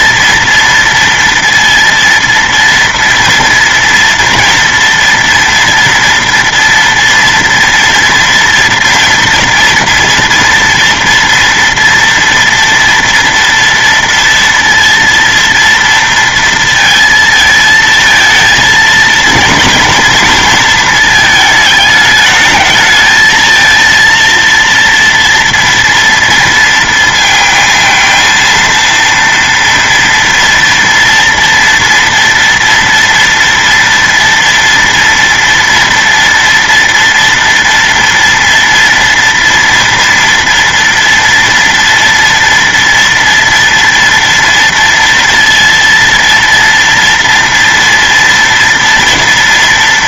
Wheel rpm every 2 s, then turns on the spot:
230, 230, 230, 230, 230, 230, 230, 230, 230, 220, 220, 220, 230, 230, 230, 230, 230, 230, 230, 240, 230, 230, 230, 230, 230.
none